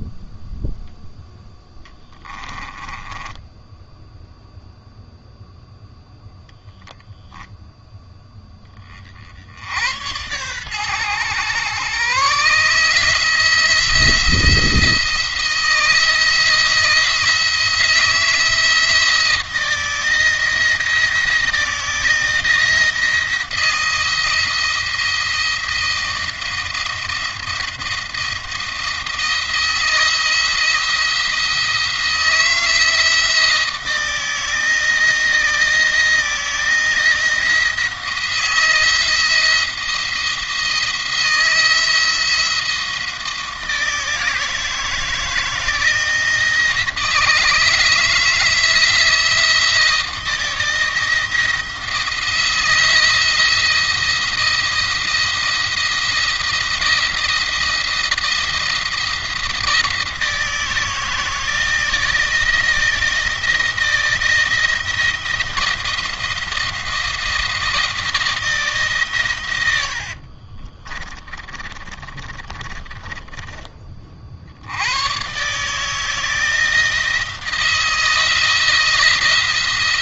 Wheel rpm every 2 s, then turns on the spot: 0, 20, 0, 0, 30, 120, 150, 170, 160, 170, 160, 160, 170, 170, 170, 170, 170, 160, 160, 170, 170, 170, 160, 160, 160, 170, 170, 170, 170, 170, 160, 170, 170, 170, 140, 40, 20, 90, 170, 160.
2-4 70-74